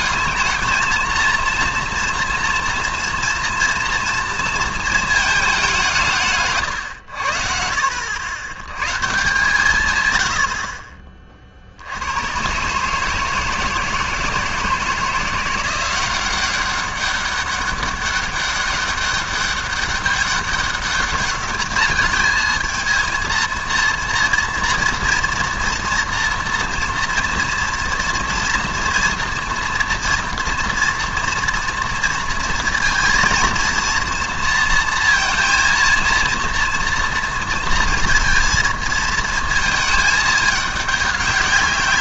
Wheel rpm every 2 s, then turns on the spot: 220, 240, 230, 140, 120, 60, 130, 160, 190, 200, 200, 220, 230, 230, 230, 230, 230, 230, 230, 230, 210.
6-8